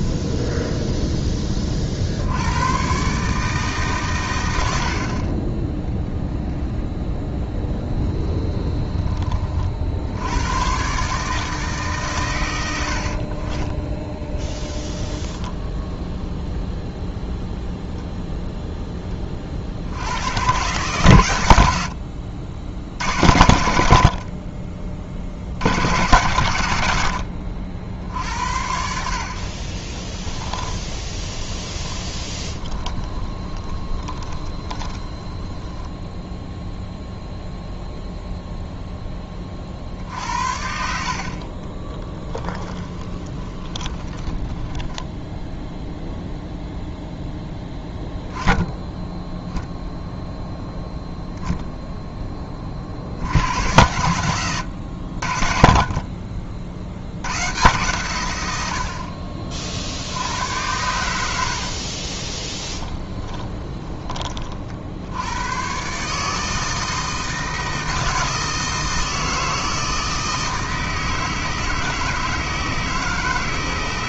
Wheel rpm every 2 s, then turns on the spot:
10, 120, 60, 0, 10, 130, 80, 10, 0, 10, 130, 70, 30, 100, 60, 20, 20, 20, 0, 10, 50, 20, 10, 0, 0, 0, 50, 80, 60, 70, 90, 20, 60, 160, 160, 160, 160.
0-2 14-16 30-36 42-46 62-64